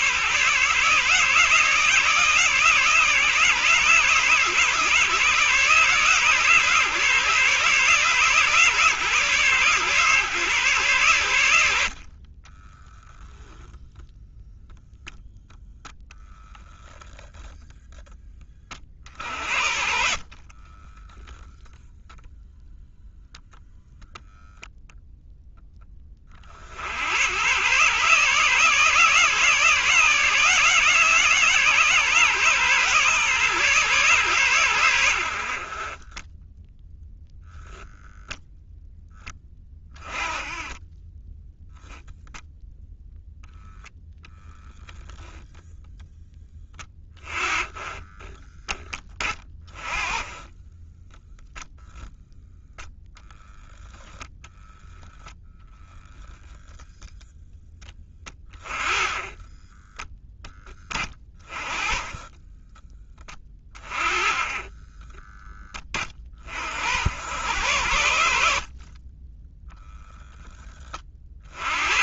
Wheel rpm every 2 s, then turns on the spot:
150, 150, 140, 150, 140, 110, 0, 0, 10, 50, 10, 0, 0, 100, 160, 160, 140, 90, 10, 10, 10, 0, 10, 20, 20, 10, 0, 0, 0, 20, 30, 20, 10, 80, 40, 40.
20-22